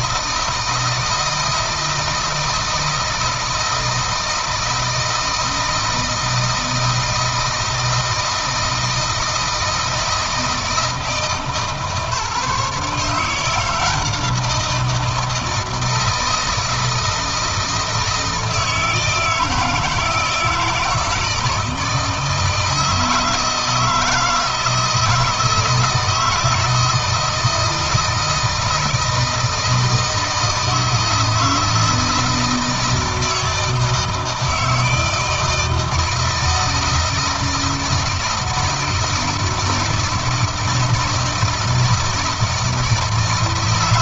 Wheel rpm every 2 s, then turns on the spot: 160, 160, 160, 160, 160, 160, 150, 170, 160, 160, 160, 160, 160, 160, 160, 160, 160, 160, 160, 160, 160, 160.
none